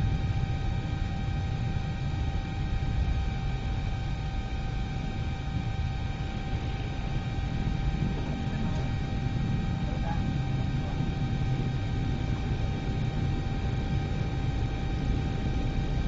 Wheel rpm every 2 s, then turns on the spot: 0, 0, 0, 0, 0, 0, 0, 0.
none